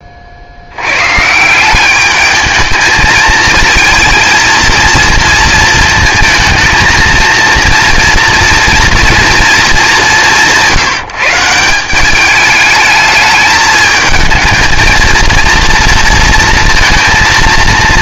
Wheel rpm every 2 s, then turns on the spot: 80, 220, 230, 220, 230, 170, 210, 230, 230.
none